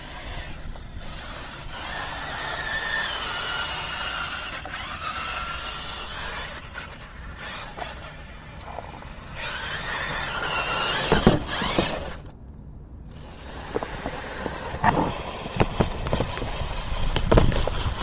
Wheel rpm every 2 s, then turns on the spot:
0, 0, 0, 0, 0, 0, 0, 0, 0.
none